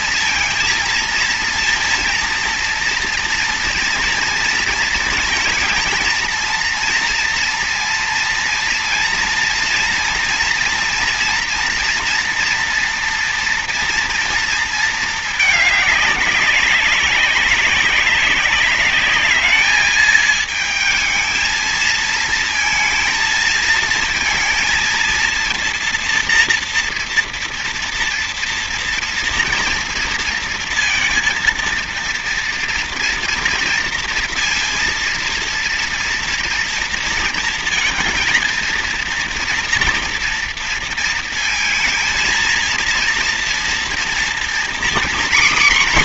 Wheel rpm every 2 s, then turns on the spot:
230, 230, 230, 230, 230, 230, 240, 220, 190, 200, 220, 230, 230, 230, 230, 230, 240, 230, 230, 230, 230, 230, 240.
none